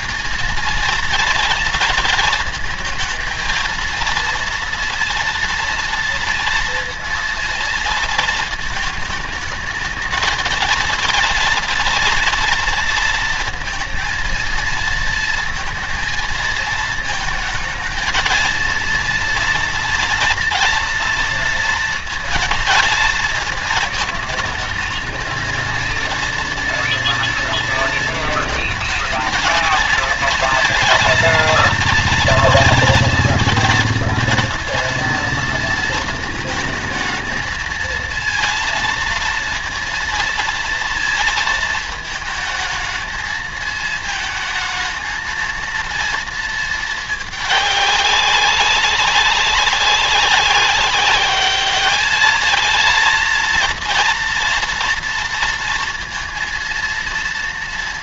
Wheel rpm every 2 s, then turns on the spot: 230, 230, 230, 230, 220, 230, 230, 230, 230, 220, 230, 230, 220, 230, 230, 230, 230, 230, 220, 230, 230, 220, 220, 220, 200, 200, 220, 230, 230.
none